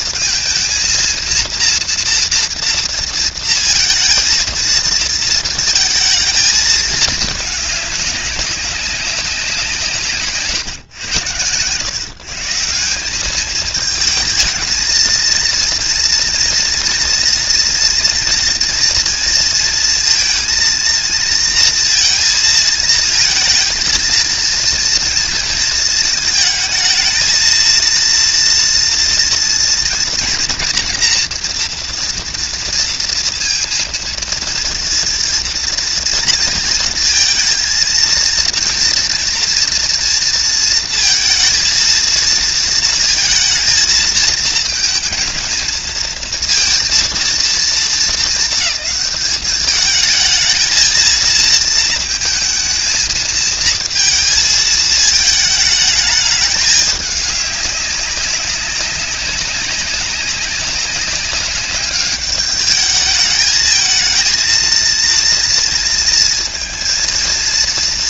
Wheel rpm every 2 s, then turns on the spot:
230, 230, 230, 220, 200, 120, 170, 220, 230, 230, 230, 230, 230, 220, 230, 240, 230, 230, 230, 230, 230, 230, 230, 230, 210, 220, 230, 220, 210, 200, 190, 210, 230, 230.
none